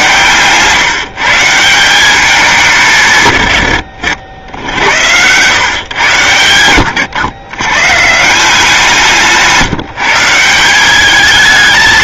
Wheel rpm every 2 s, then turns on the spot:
140, 180, 80, 110, 180, 180.
none